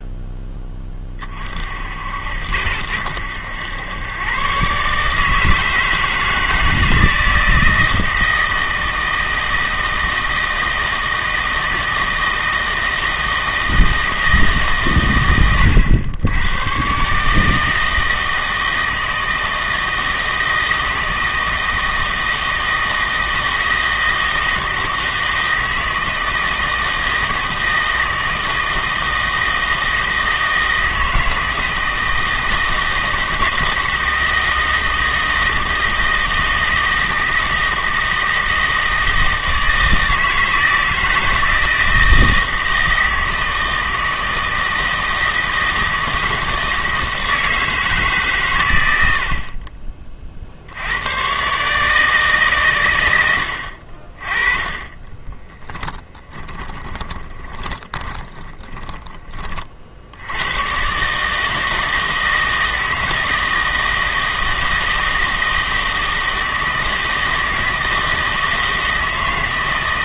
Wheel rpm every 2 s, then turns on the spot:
20, 80, 140, 160, 160, 160, 160, 140, 110, 160, 160, 160, 160, 160, 160, 160, 160, 160, 160, 160, 160, 160, 160, 160, 110, 70, 140, 20, 20, 10, 110, 160, 160, 160, 160.
56-60